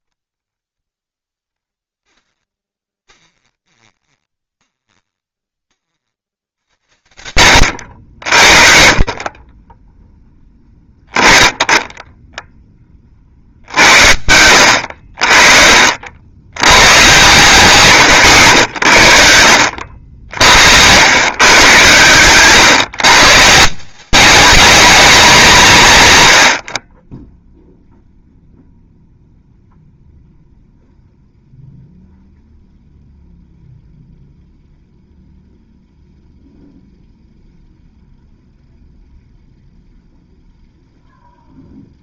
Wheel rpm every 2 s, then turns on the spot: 10, 20, 10, 80, 40, 10, 20, 60, 110, 70, 100, 140, 210, 20, 0, 0, 0, 0, 0, 0, 0.
2-8